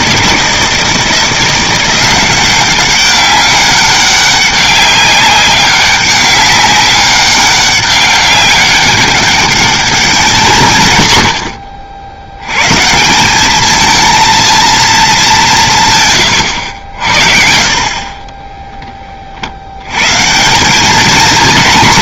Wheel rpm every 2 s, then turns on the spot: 160, 190, 200, 200, 200, 170, 130, 220, 90, 10, 190.
none